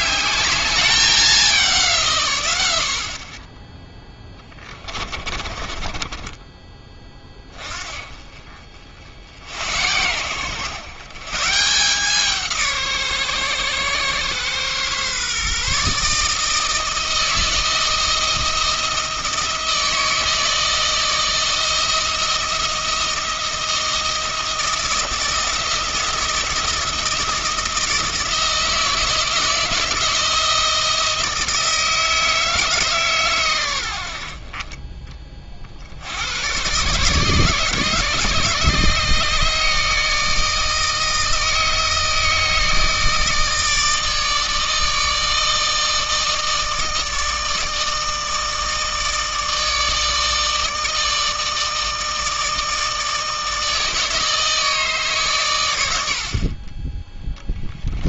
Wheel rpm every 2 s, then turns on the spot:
200, 80, 30, 20, 60, 130, 150, 130, 160, 160, 160, 160, 160, 160, 160, 160, 150, 20, 120, 150, 160, 160, 160, 160, 160, 160, 160, 150, 30.
4-6